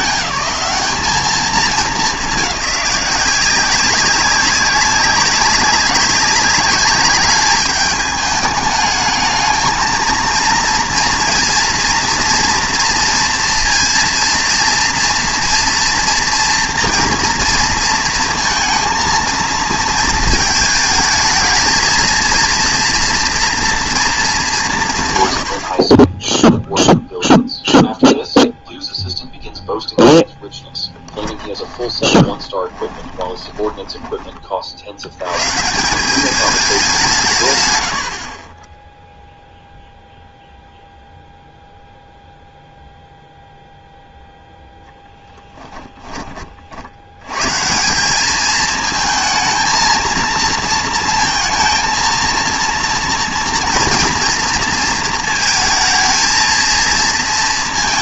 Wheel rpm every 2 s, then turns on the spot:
210, 200, 190, 200, 210, 230, 230, 230, 230, 230, 220, 230, 170, 0, 0, 10, 20, 50, 200, 20, 0, 0, 0, 40, 220, 230, 230, 230, 220.
30-34